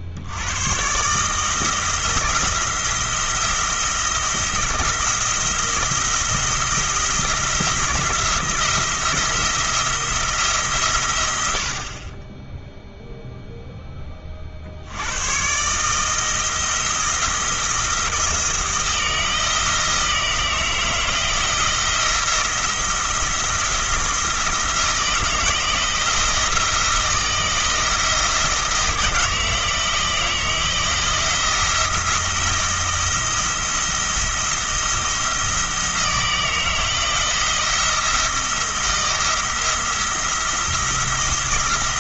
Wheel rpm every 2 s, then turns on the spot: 100, 170, 170, 170, 170, 160, 10, 50, 160, 160, 160, 170, 170, 170, 160, 160, 170, 170, 160, 170, 170.
none